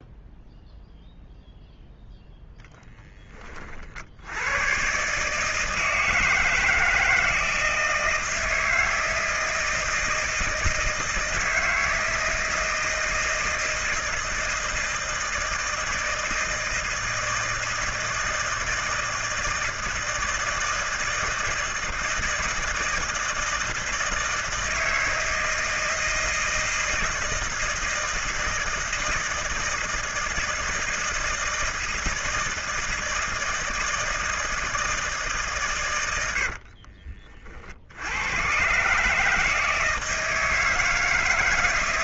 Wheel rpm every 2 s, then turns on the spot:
0, 10, 130, 170, 160, 160, 160, 160, 160, 160, 160, 160, 160, 160, 160, 160, 160, 160, 60, 140, 160.
36-38